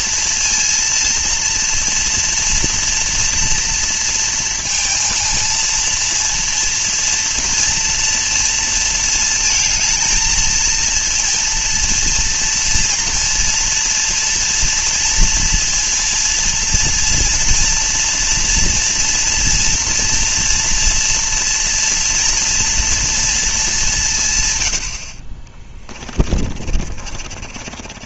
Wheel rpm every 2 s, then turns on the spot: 230, 230, 230, 230, 220, 230, 230, 230, 230, 230, 230, 230, 70, 40.
26-28